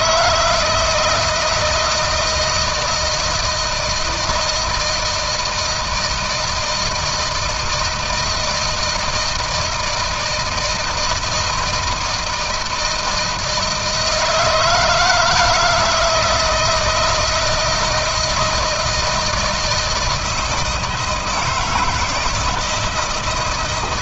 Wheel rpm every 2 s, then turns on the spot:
160, 160, 160, 160, 160, 160, 170, 160, 160, 160, 160, 160.
none